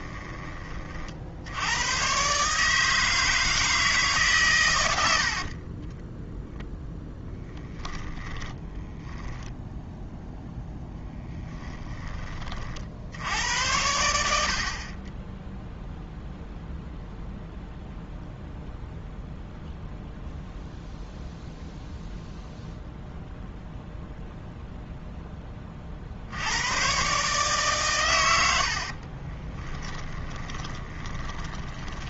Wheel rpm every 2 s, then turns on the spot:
30, 150, 100, 0, 10, 0, 50, 50, 0, 0, 0, 0, 0, 100, 60, 20.
8-10 28-32